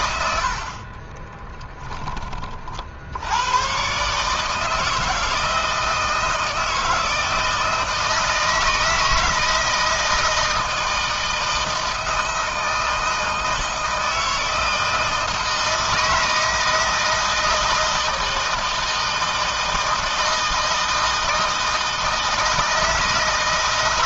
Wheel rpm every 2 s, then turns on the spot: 50, 50, 160, 160, 160, 160, 160, 160, 160, 160, 160, 160.
0-2